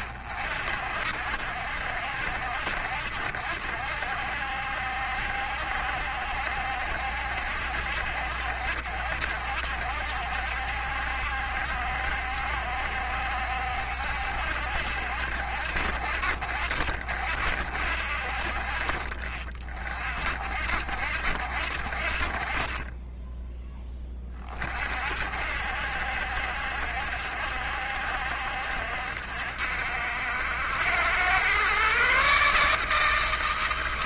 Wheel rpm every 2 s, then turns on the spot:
60, 70, 70, 70, 70, 70, 70, 70, 60, 60, 50, 40, 30, 70, 70, 80, 150.
none